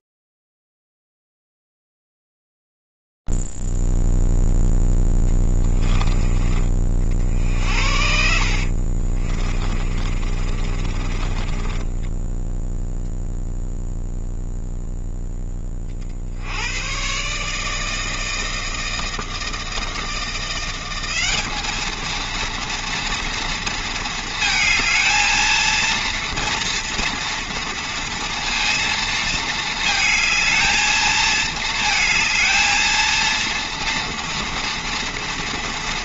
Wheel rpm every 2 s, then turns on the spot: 0, 0, 0, 30, 60, 30, 10, 0, 80, 160, 170, 230, 220, 230, 230, 220, 230, 230.
8-14